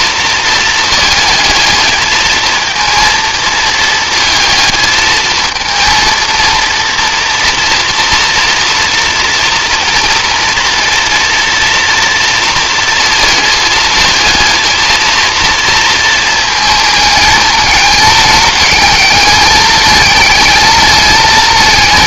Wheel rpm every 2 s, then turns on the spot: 230, 220, 220, 230, 230, 230, 230, 220, 220, 210, 220.
none